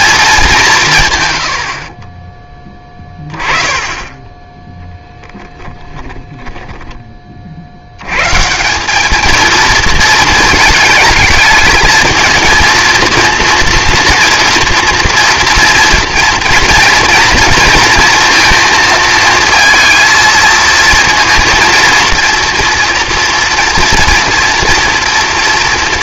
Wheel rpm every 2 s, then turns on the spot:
180, 10, 10, 10, 180, 220, 230, 240, 230, 230, 230, 230, 230.
none